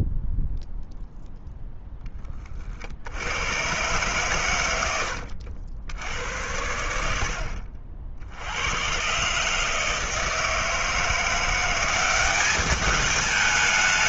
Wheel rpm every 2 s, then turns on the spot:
0, 30, 130, 70, 80, 160, 200.
none